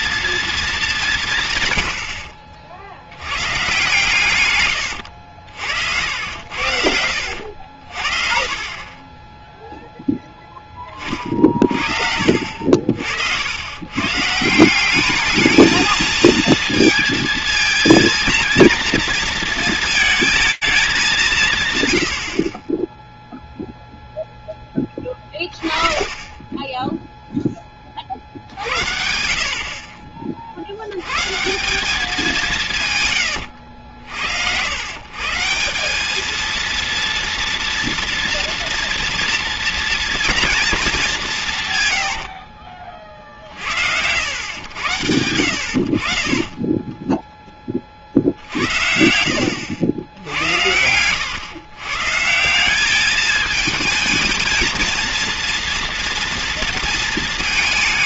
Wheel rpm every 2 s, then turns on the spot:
220, 60, 110, 80, 40, 20, 60, 170, 230, 230, 220, 40, 0, 10, 70, 90, 150, 120, 230, 230, 210, 50, 90, 20, 70, 120, 220, 240, 220.
4-8 48-50